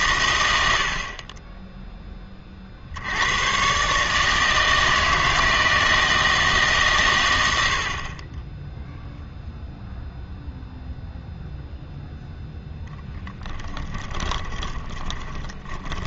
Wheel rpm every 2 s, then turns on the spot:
90, 30, 160, 150, 10, 0, 0, 20.
14-16